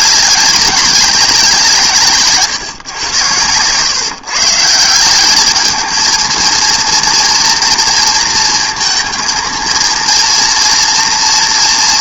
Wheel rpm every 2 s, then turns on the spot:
200, 140, 160, 230, 220, 230.
none